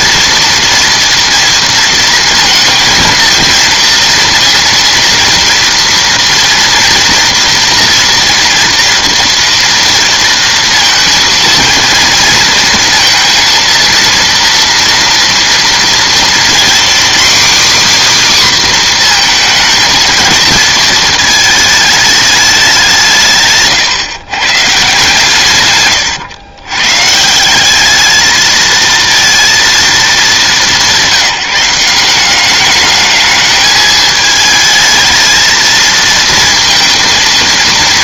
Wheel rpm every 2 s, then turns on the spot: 240, 230, 230, 230, 230, 230, 230, 230, 250, 260, 230, 180, 150, 120, 220, 200, 200, 220, 230.
none